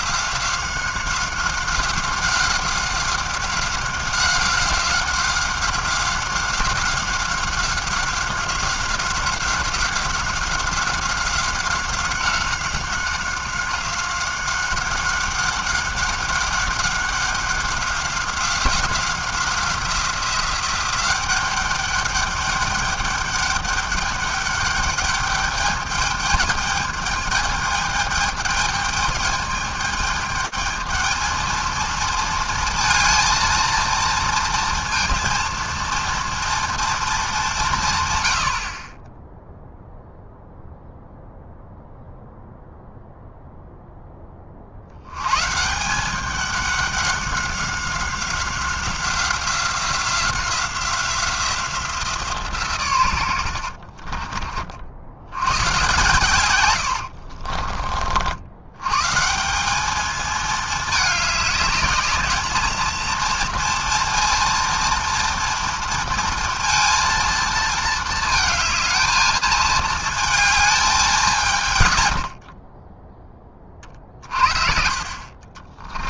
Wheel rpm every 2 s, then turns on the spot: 190, 190, 190, 190, 190, 190, 190, 190, 200, 190, 190, 200, 200, 210, 210, 220, 230, 230, 230, 70, 0, 0, 40, 200, 190, 180, 150, 40, 120, 90, 220, 210, 230, 230, 220, 220, 40, 40.
56-58